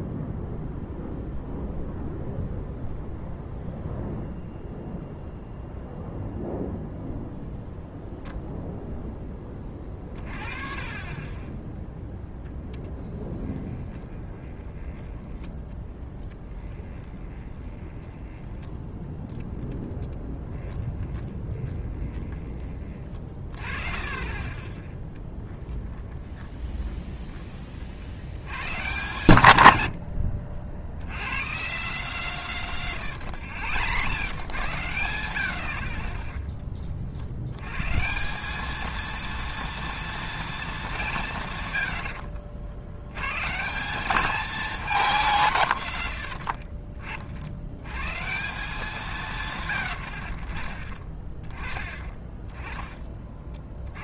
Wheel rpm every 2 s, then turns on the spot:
0, 0, 0, 0, 0, 30, 10, 20, 20, 20, 20, 30, 20, 20, 100, 70, 140, 100, 20, 180, 200, 60, 220, 80, 160, 40, 30.
12-22 26-28 46-48 52-54